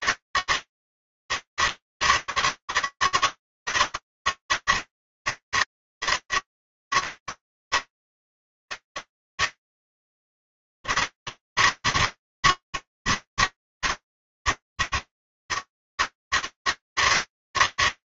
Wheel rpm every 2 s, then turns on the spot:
150, 150, 150, 150, 140, 160, 140, 150, 160.
none